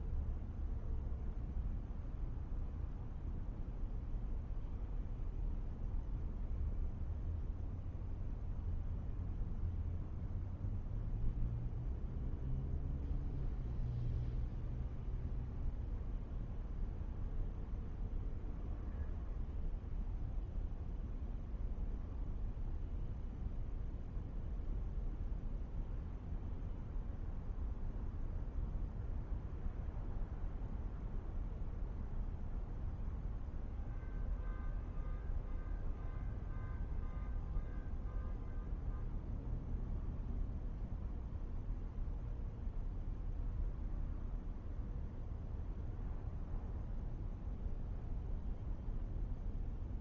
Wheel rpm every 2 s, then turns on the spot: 0, 0, 0, 0, 0, 0, 0, 0, 0, 0, 0, 0, 0, 0, 0, 0, 0, 0, 0, 0, 0, 0, 0, 0, 0.
none